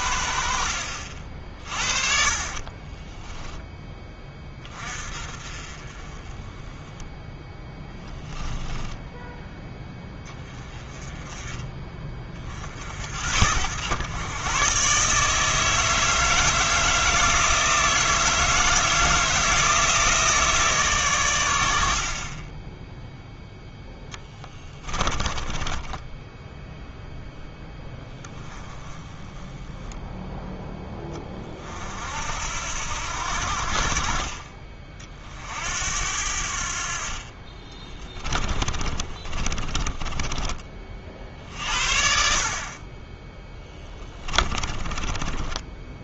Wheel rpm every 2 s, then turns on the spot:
50, 20, 30, 10, 10, 20, 50, 130, 160, 160, 150, 10, 20, 0, 10, 10, 80, 40, 60, 30, 40, 30, 20.
2-4 8-10 24-26 38-40 44-46